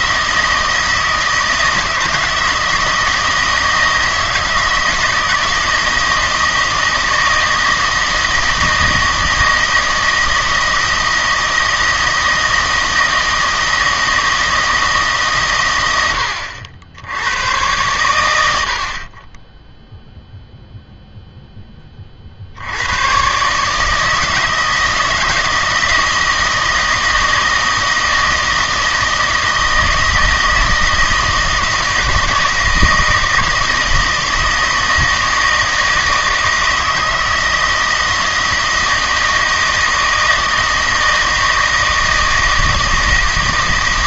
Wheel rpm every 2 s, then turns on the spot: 160, 160, 160, 160, 160, 160, 160, 160, 80, 60, 0, 90, 160, 160, 160, 160, 160, 160, 160, 160, 160, 160.
none